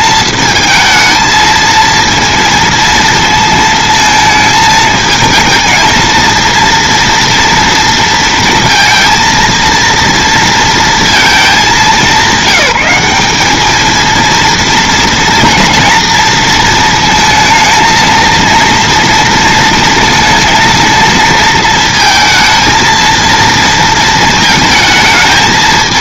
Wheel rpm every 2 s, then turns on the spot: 220, 230, 220, 230, 230, 230, 200, 230, 230, 230, 230, 230, 220.
none